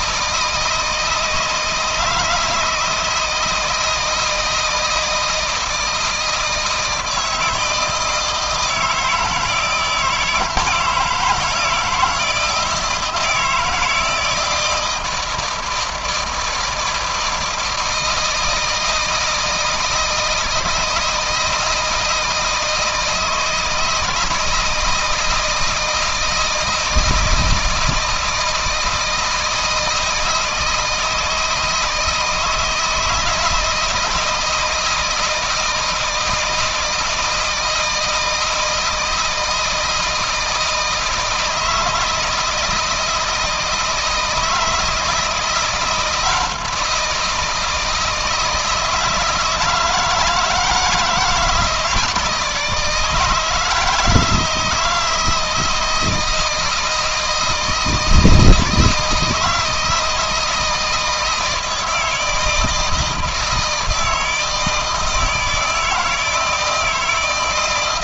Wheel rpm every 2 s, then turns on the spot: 160, 160, 160, 160, 160, 160, 170, 160, 160, 160, 160, 160, 160, 160, 160, 160, 160, 160, 160, 160, 160, 160, 160, 170, 160, 160, 150, 160, 160, 160, 160, 160, 160, 160.
none